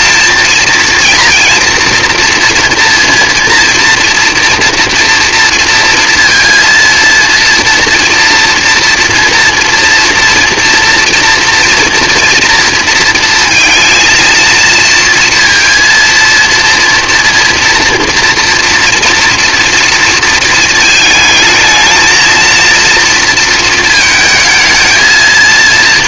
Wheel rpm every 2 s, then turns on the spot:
230, 230, 230, 230, 230, 230, 230, 230, 230, 230, 230, 230, 220.
none